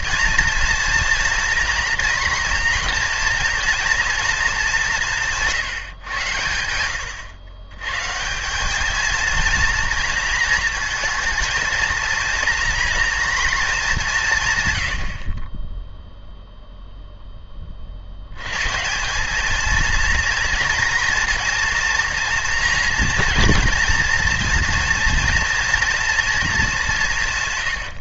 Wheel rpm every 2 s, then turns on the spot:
230, 240, 200, 100, 200, 230, 230, 110, 0, 140, 230, 230, 230, 210.
none